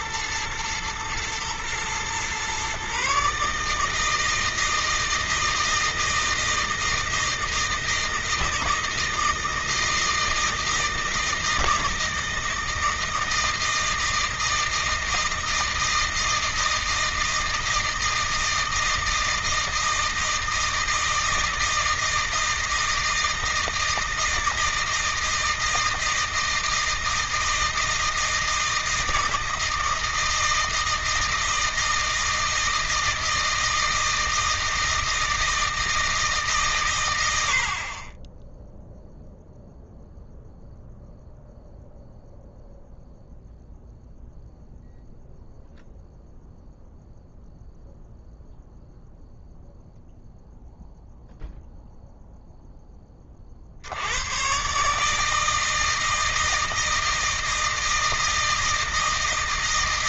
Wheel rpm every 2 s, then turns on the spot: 110, 130, 160, 160, 160, 160, 160, 160, 160, 160, 160, 160, 160, 160, 160, 160, 160, 160, 120, 0, 0, 0, 0, 0, 0, 0, 10, 140, 160, 160.
none